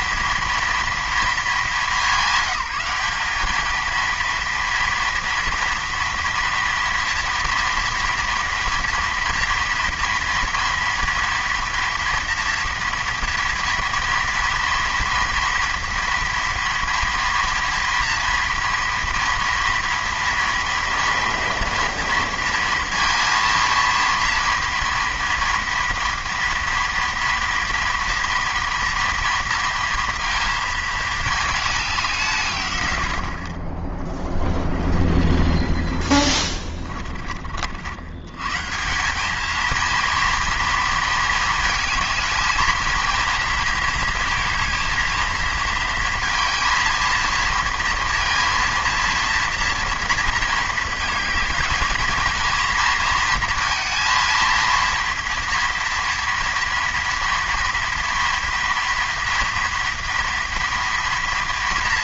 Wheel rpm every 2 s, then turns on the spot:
210, 210, 230, 230, 230, 230, 230, 230, 230, 230, 230, 230, 230, 230, 230, 220, 60, 50, 40, 200, 220, 230, 230, 230, 230, 220, 230, 230, 230, 230, 230.
none